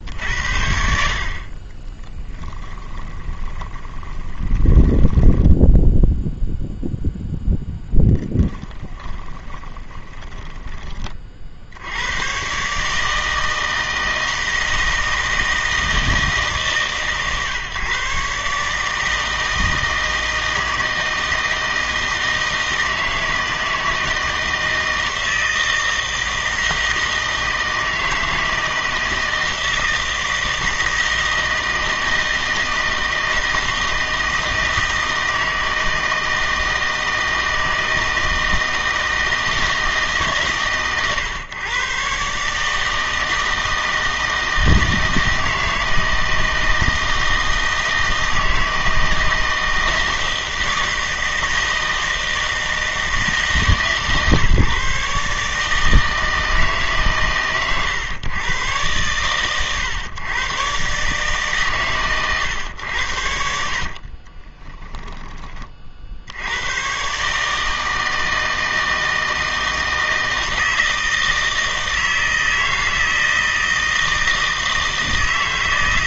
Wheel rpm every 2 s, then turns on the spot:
60, 20, 20, 0, 10, 20, 140, 160, 140, 150, 160, 160, 160, 160, 160, 160, 160, 160, 160, 160, 140, 150, 160, 160, 160, 160, 160, 140, 150, 120, 130, 90, 10, 110, 160, 160, 160, 160.
2-6 8-10 64-66